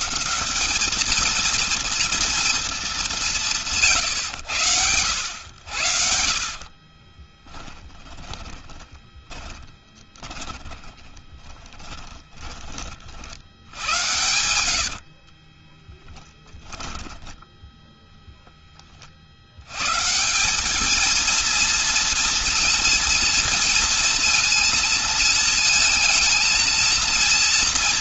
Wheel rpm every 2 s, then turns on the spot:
210, 210, 100, 40, 20, 20, 40, 90, 10, 20, 210, 230, 230, 230.
6-12 14-18